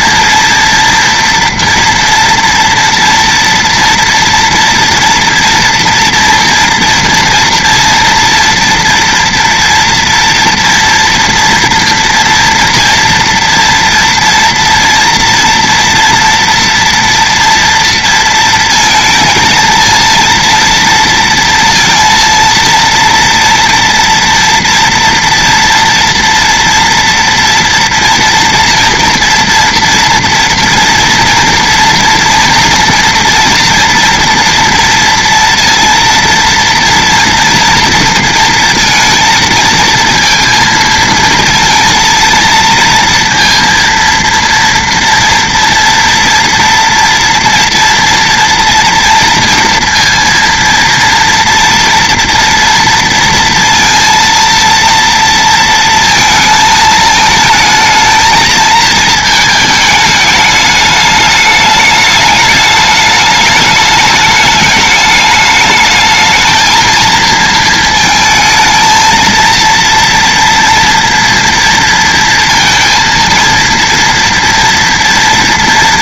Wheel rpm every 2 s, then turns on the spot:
230, 230, 240, 230, 230, 230, 230, 230, 240, 230, 230, 230, 230, 230, 230, 230, 230, 230, 230, 230, 230, 230, 230, 240, 240, 230, 230, 230, 220, 220, 210, 210, 210, 220, 220, 230, 230, 230.
none